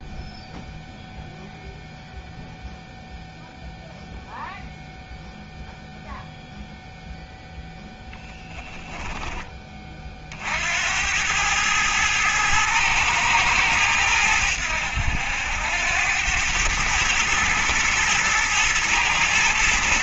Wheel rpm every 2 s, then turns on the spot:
0, 0, 0, 0, 10, 80, 110, 80, 110, 110.
8-10